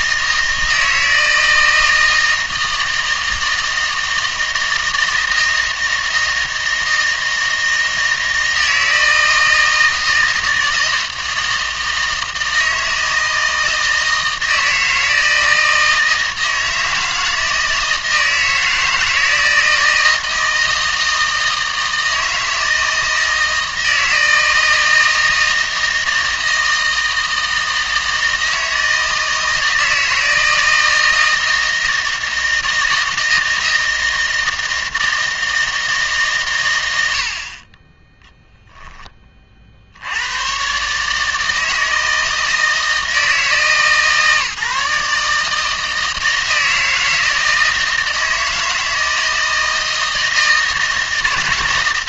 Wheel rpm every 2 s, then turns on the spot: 160, 160, 160, 160, 160, 160, 160, 160, 160, 160, 160, 160, 160, 160, 160, 160, 160, 160, 100, 10, 130, 160, 150, 160, 160, 160.
none